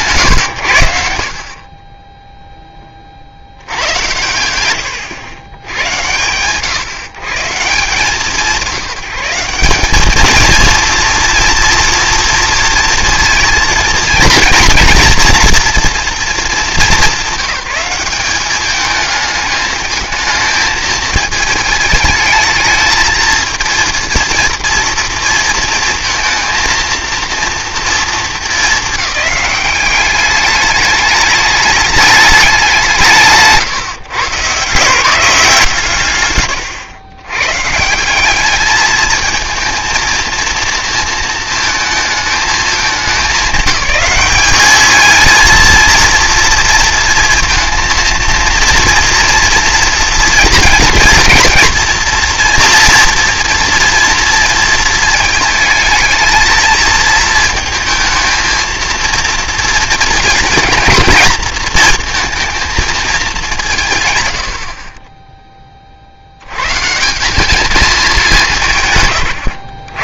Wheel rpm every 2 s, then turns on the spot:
110, 0, 100, 130, 170, 230, 230, 230, 220, 200, 220, 220, 230, 230, 220, 210, 190, 140, 120, 210, 230, 210, 220, 230, 230, 230, 230, 220, 220, 230, 240, 220, 60, 130, 160.
none